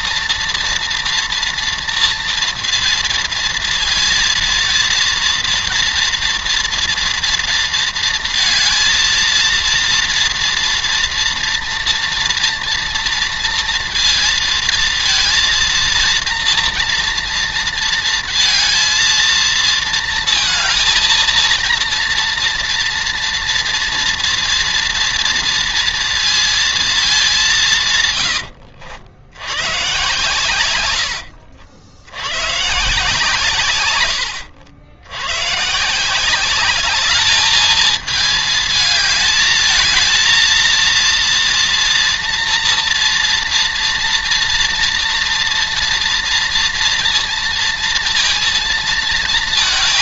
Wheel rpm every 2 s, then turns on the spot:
240, 230, 230, 230, 230, 230, 230, 230, 230, 230, 230, 230, 230, 230, 100, 120, 130, 100, 190, 220, 230, 230, 230, 230, 230.
none